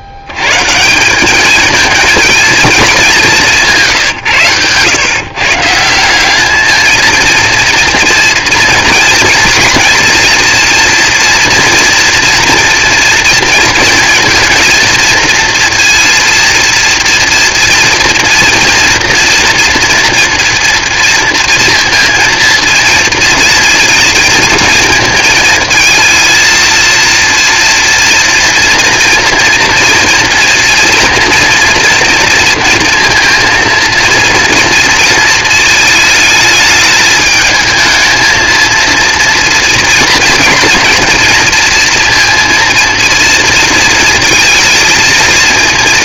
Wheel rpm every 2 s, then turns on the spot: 140, 220, 120, 210, 240, 240, 230, 230, 230, 230, 230, 230, 230, 230, 230, 230, 230, 230, 220, 230, 230, 230, 220.
none